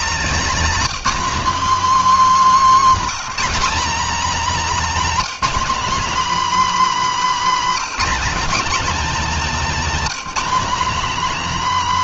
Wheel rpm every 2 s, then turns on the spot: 260, 260, 270, 280, 260, 250.
none